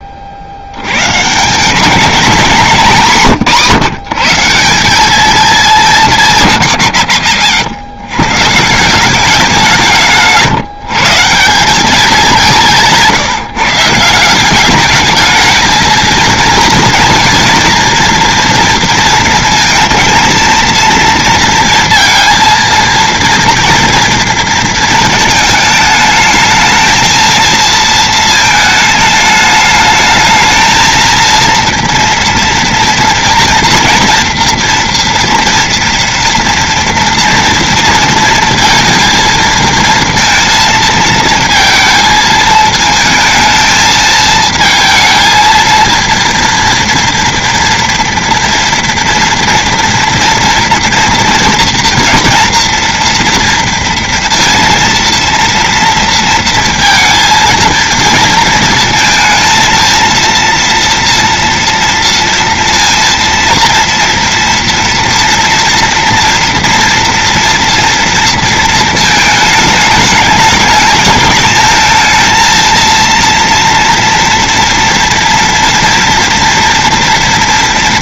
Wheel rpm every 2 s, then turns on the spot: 20, 200, 170, 190, 120, 170, 200, 170, 220, 230, 220, 230, 230, 210, 230, 220, 230, 230, 230, 230, 230, 230, 220, 230, 230, 230, 230, 230, 230, 220, 230, 230, 230, 230, 230, 210, 220, 230, 230.
10-12